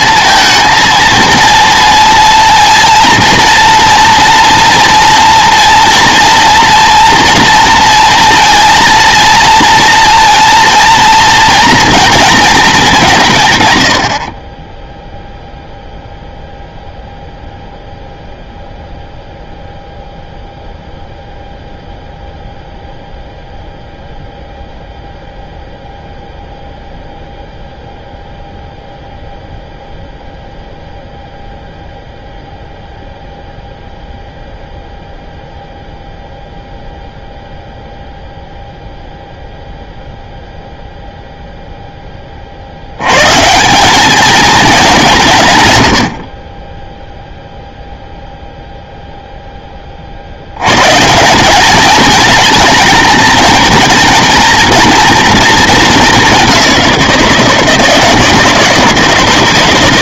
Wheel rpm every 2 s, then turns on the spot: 230, 230, 240, 230, 230, 230, 210, 10, 0, 0, 0, 0, 0, 0, 0, 0, 0, 0, 0, 0, 0, 90, 210, 20, 0, 130, 220, 230, 190, 170.
none